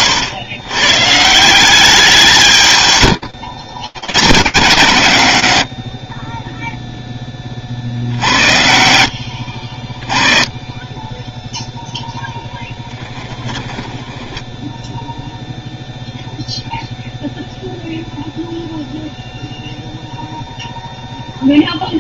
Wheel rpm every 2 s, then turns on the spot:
150, 120, 100, 20, 60, 10, 10, 0, 0, 0, 0.
2-4 12-14